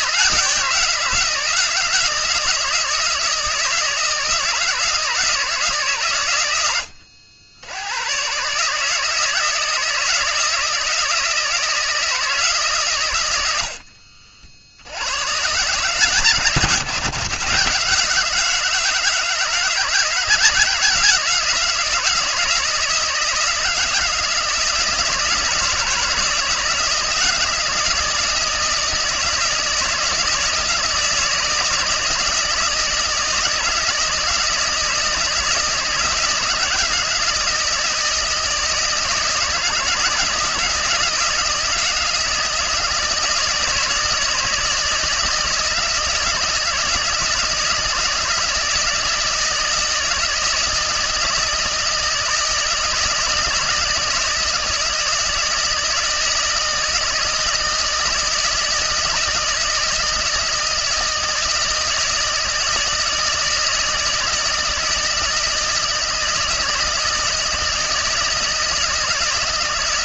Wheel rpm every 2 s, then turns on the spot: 170, 160, 160, 90, 150, 160, 130, 80, 140, 160, 170, 160, 160, 160, 160, 160, 160, 160, 160, 160, 170, 160, 160, 160, 160, 160, 160, 160, 160, 160, 160, 160, 160, 160, 160.
none